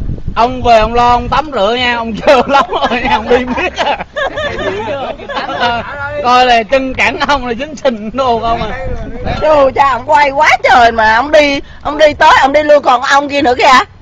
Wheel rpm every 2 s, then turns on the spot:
0, 0, 0, 0, 0, 0, 0.
none